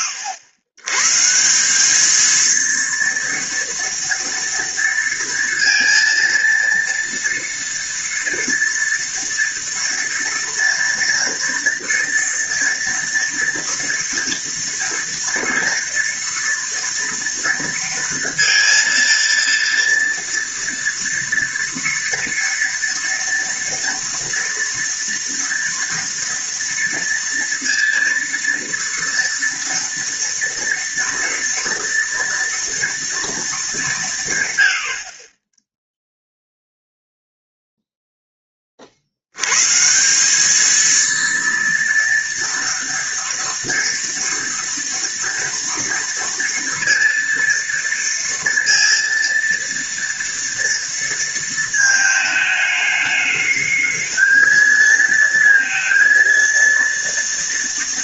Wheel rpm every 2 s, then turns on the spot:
110, 230, 230, 230, 230, 230, 230, 230, 230, 230, 230, 230, 230, 230, 230, 230, 230, 70, 0, 50, 220, 230, 230, 230, 230, 230, 210, 220, 230.
none